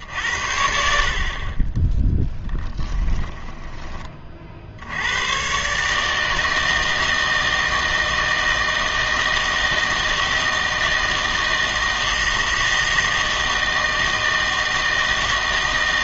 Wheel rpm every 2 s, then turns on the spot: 70, 10, 60, 160, 160, 160, 160, 160.
2-4